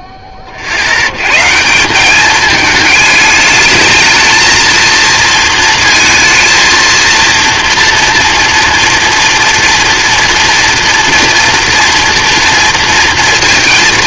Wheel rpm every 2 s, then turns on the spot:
60, 210, 220, 220, 230, 230, 230.
none